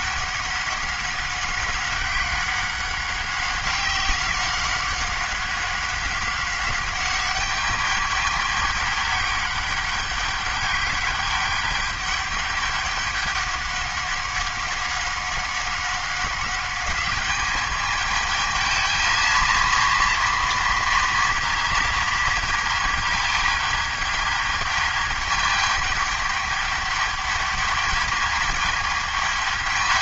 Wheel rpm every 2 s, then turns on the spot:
200, 190, 190, 200, 200, 200, 200, 190, 210, 220, 230, 220, 210, 210, 210.
none